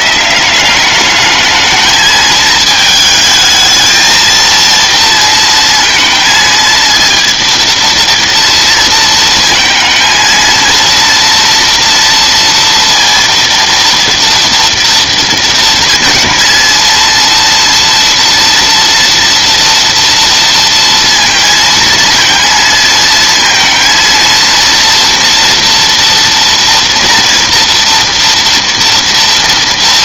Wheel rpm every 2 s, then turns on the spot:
200, 220, 230, 230, 230, 230, 230, 230, 230, 230, 230, 230, 230, 230, 230.
none